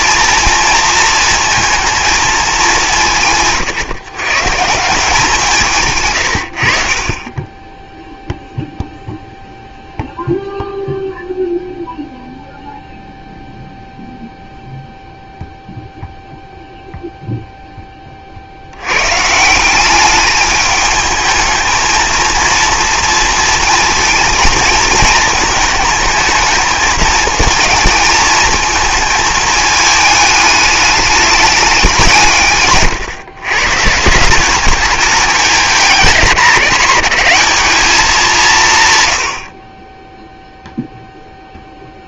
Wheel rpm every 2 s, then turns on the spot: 230, 190, 160, 60, 0, 0, 0, 0, 0, 80, 210, 230, 220, 220, 220, 210, 150, 200, 200, 160, 0.
32-34